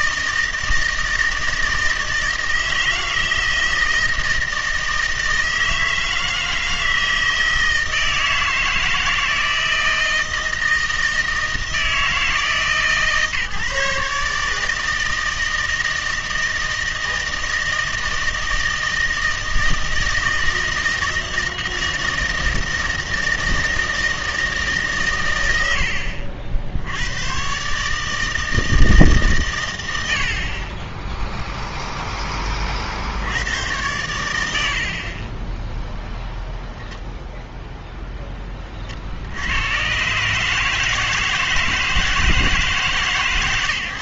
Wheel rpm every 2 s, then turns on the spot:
160, 160, 160, 160, 160, 160, 150, 160, 160, 160, 160, 160, 140, 70, 160, 20, 50, 70, 0, 30, 150, 150.
none